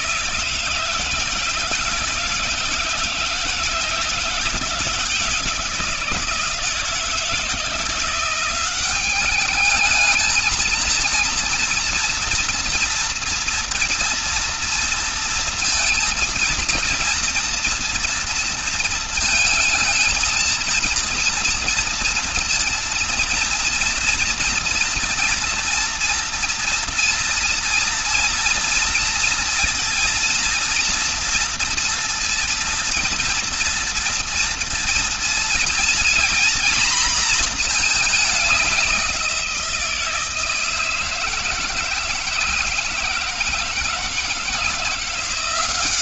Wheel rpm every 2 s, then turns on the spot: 160, 160, 170, 160, 190, 220, 240, 230, 230, 230, 230, 230, 240, 230, 230, 230, 230, 230, 240, 190, 160, 170, 170.
none